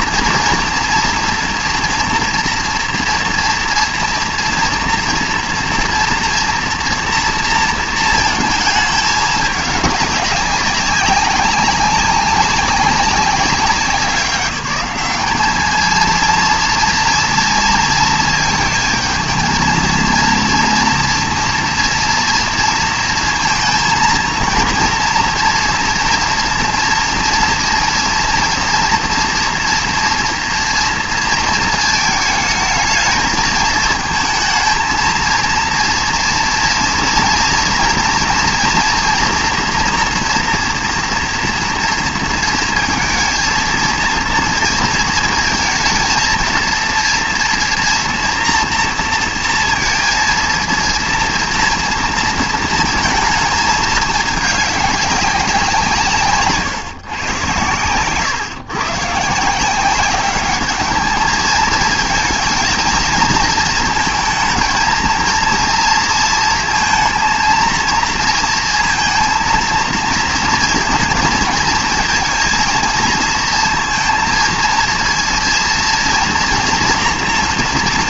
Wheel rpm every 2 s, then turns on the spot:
230, 230, 240, 230, 220, 200, 200, 200, 230, 220, 230, 230, 230, 230, 230, 230, 210, 230, 240, 230, 230, 230, 230, 230, 230, 230, 220, 200, 130, 130, 210, 230, 230, 230, 230, 230, 220, 230, 230.
none